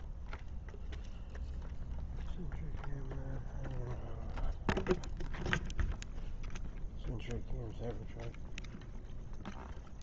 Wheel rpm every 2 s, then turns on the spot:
0, 0, 0, 0, 0.
none